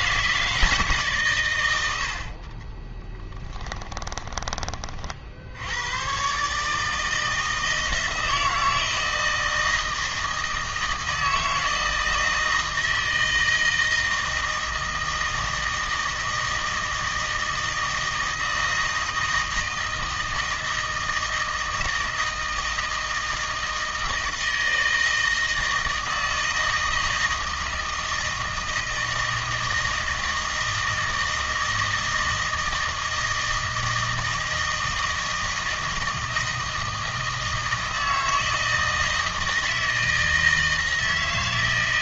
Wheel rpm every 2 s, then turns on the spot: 150, 30, 20, 150, 160, 160, 160, 160, 160, 160, 160, 160, 160, 160, 160, 160, 160, 160, 160, 160, 160.
2-4